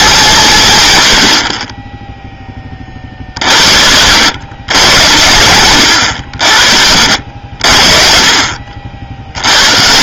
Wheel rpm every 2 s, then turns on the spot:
110, 30, 100, 60, 60.
none